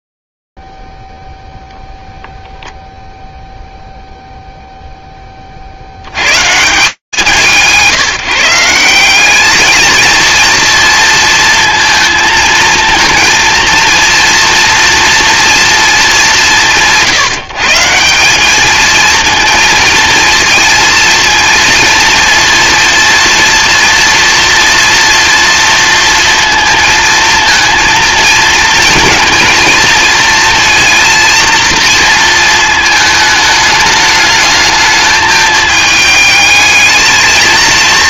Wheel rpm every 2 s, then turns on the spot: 50, 0, 0, 120, 170, 230, 230, 230, 190, 200, 230, 230, 230, 230, 230, 230, 230, 220, 220.
none